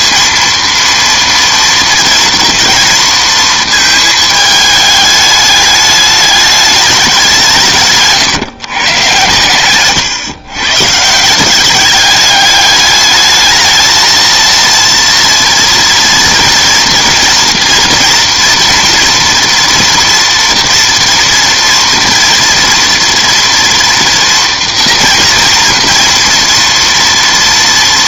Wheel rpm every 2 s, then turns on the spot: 230, 230, 210, 200, 130, 140, 210, 230, 230, 230, 230, 240, 240, 230.
none